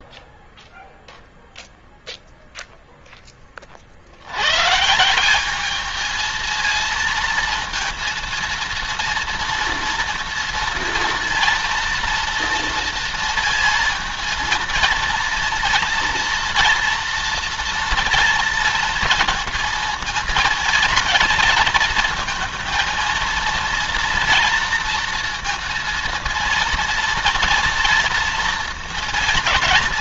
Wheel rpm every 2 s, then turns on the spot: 0, 0, 120, 220, 230, 230, 230, 230, 240, 230, 220, 230, 230, 230, 230.
none